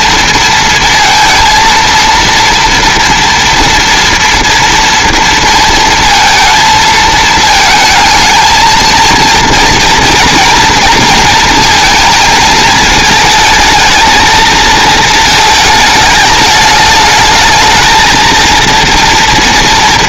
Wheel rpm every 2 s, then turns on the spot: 230, 230, 230, 220, 230, 230, 220, 220, 220, 230.
none